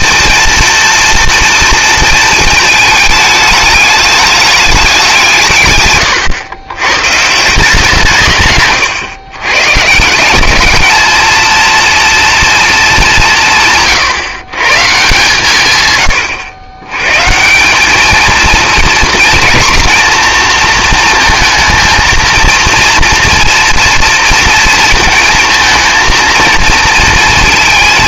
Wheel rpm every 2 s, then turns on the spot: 230, 220, 210, 110, 130, 210, 230, 140, 100, 230, 230, 230, 230, 230.
none